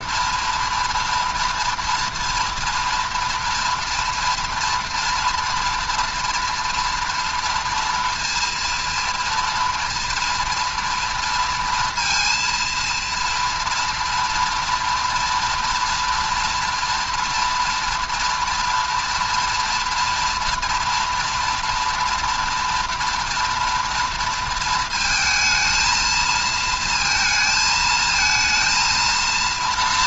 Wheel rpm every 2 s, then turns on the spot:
230, 230, 230, 230, 230, 230, 230, 230, 230, 230, 230, 240, 230, 230, 230.
none